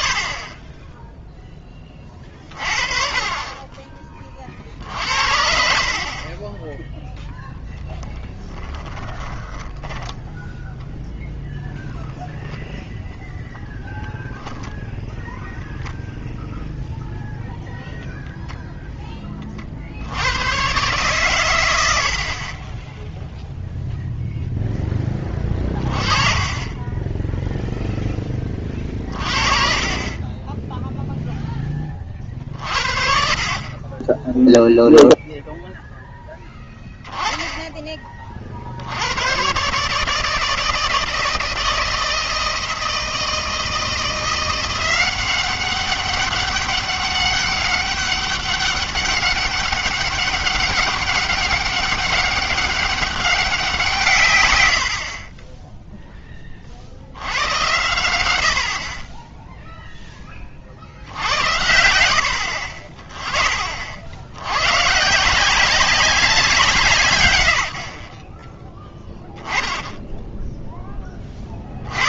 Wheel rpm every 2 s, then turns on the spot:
50, 30, 70, 0, 10, 0, 0, 0, 0, 0, 120, 20, 0, 30, 20, 10, 60, 0, 10, 50, 160, 160, 180, 200, 200, 200, 200, 120, 40, 60, 50, 40, 100, 160, 10, 0.
8-10